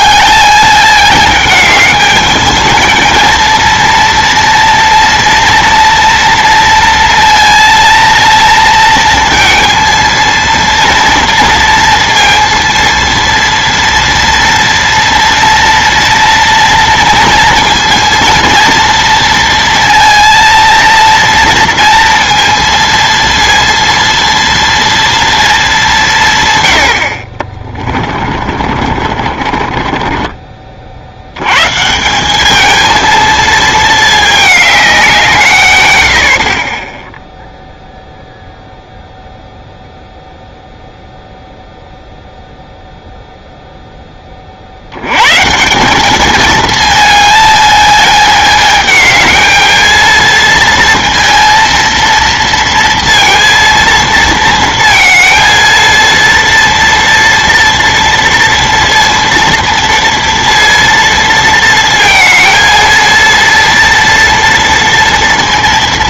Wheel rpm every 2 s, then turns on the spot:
210, 220, 230, 230, 230, 230, 230, 230, 230, 230, 230, 230, 230, 100, 40, 40, 220, 200, 30, 0, 0, 0, 50, 220, 220, 230, 230, 230, 230, 230, 230, 220, 230.
28-30